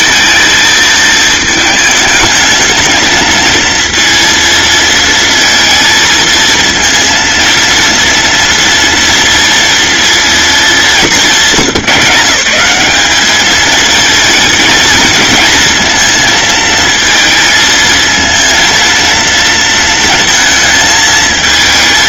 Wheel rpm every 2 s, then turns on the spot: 220, 220, 230, 230, 230, 190, 190, 220, 220, 230, 220.
none